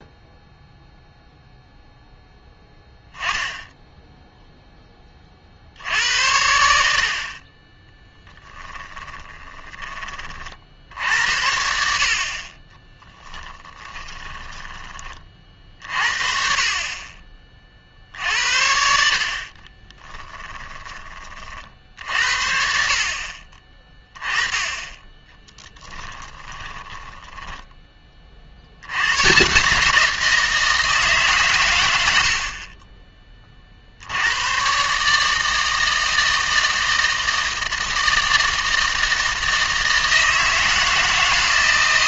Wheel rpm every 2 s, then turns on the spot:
0, 10, 10, 70, 10, 60, 20, 20, 40, 60, 20, 60, 20, 10, 80, 160, 40, 130, 160, 160, 160.
8-10 20-22 26-28